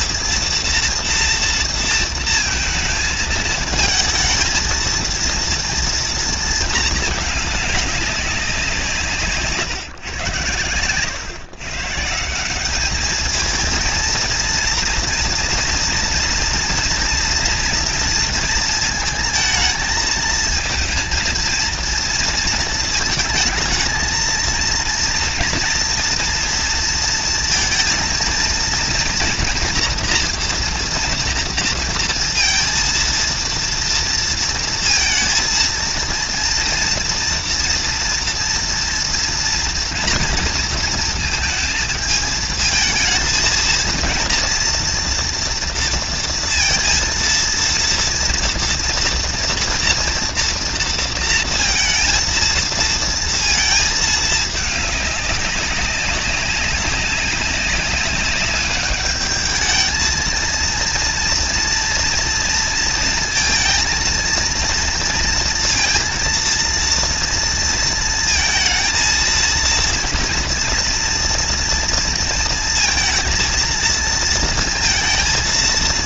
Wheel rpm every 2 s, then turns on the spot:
230, 230, 230, 230, 190, 110, 200, 230, 230, 220, 220, 220, 230, 230, 230, 240, 230, 230, 230, 230, 230, 220, 230, 230, 230, 230, 230, 210, 200, 200, 230, 230, 230, 230, 230, 230, 230, 230.
none